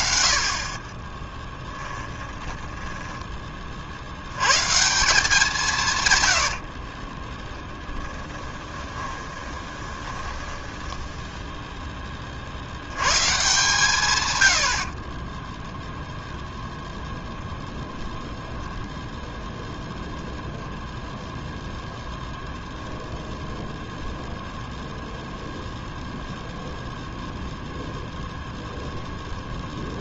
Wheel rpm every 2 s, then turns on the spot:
30, 10, 150, 50, 20, 10, 100, 50, 0, 10, 0, 0, 0, 0, 0.
2-4 6-12 14-16 18-20